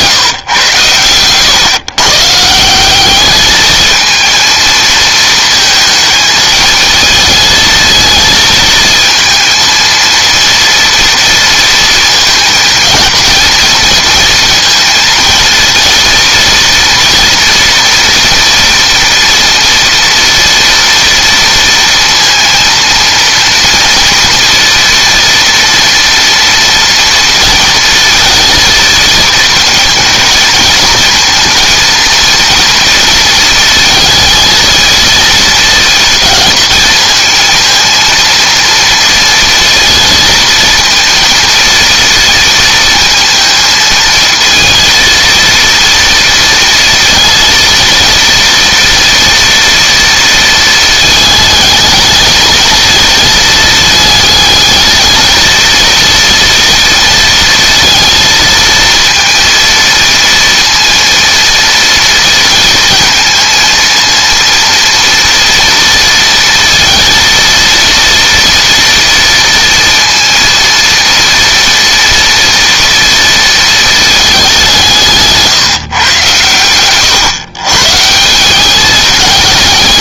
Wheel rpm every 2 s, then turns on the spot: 120, 180, 220, 220, 230, 230, 220, 230, 230, 230, 230, 230, 240, 230, 230, 220, 230, 220, 220, 230, 230, 230, 230, 230, 230, 220, 220, 220, 230, 230, 230, 230, 230, 230, 230, 230, 230, 180, 110, 200.
none